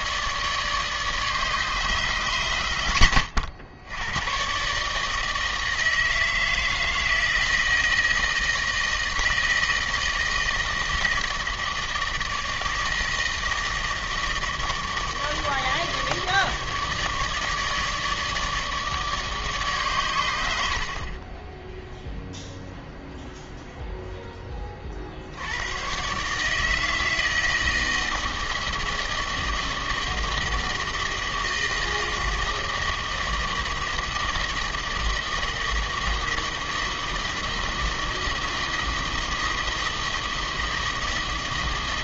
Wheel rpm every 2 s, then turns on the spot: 150, 100, 150, 160, 160, 160, 160, 160, 150, 150, 60, 0, 50, 160, 160, 160, 160, 160, 160, 160, 160.
none